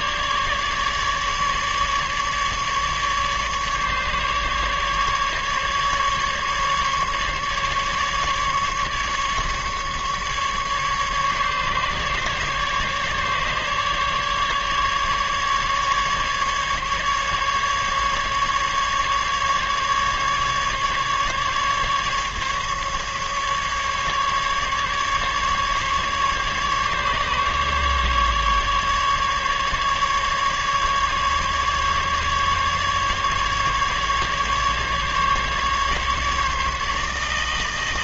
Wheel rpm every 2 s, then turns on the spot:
150, 150, 150, 140, 150, 150, 150, 150, 140, 140, 150, 150, 140, 140, 150, 150, 140, 150, 150.
none